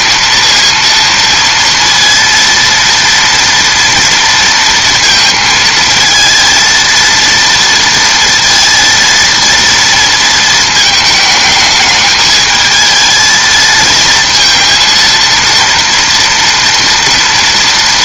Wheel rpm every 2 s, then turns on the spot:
230, 230, 230, 230, 230, 220, 220, 230, 230.
none